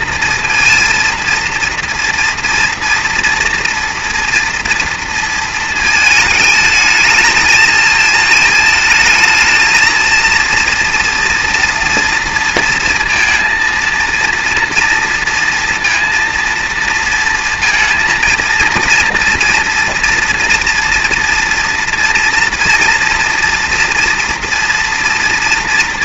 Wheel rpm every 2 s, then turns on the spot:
230, 230, 240, 210, 220, 230, 230, 230, 230, 230, 240, 230, 230.
none